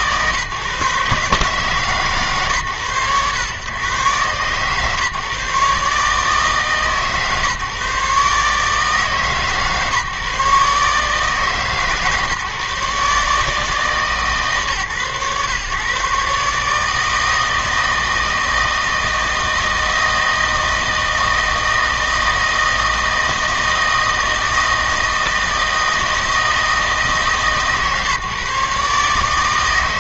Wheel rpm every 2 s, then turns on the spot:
140, 120, 140, 150, 150, 150, 150, 140, 150, 160, 160, 160, 160, 160, 140.
none